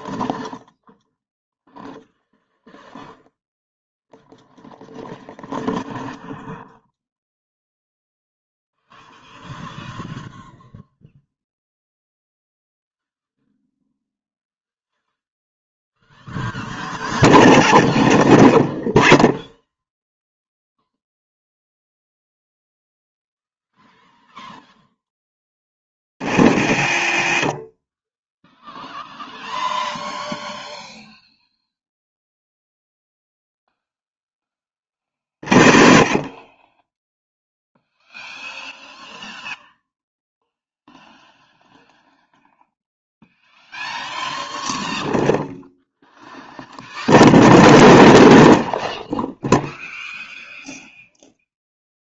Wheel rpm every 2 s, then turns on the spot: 0, 0, 0, 0, 0, 0, 0, 0, 0, 0, 0, 0, 0, 30, 0, 0, 0, 20, 20, 0, 0, 0, 0, 0, 0, 0.
26-28